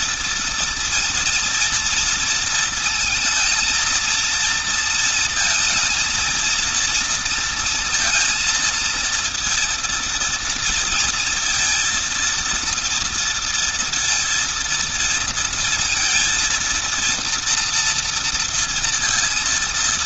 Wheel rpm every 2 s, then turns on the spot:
230, 220, 230, 230, 230, 230, 230, 230, 230, 230.
none